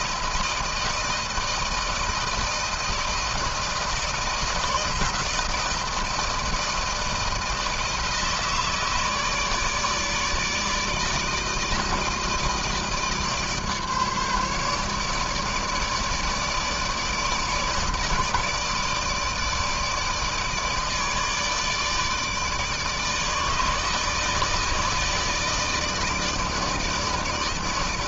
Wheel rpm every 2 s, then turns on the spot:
160, 170, 160, 160, 160, 150, 160, 150, 150, 150, 150, 150, 160, 160.
none